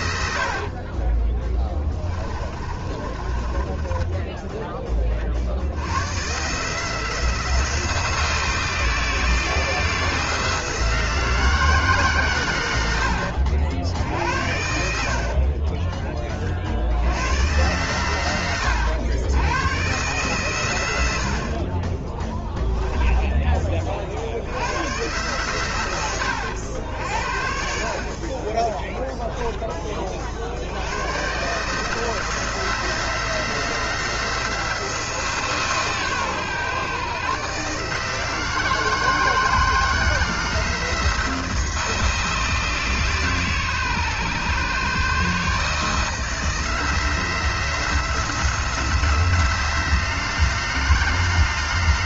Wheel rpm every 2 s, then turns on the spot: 50, 30, 20, 150, 160, 160, 90, 70, 70, 100, 100, 10, 100, 80, 20, 80, 160, 160, 130, 160, 160, 150, 140, 160, 160, 160.
2-4 14-16 22-24 28-30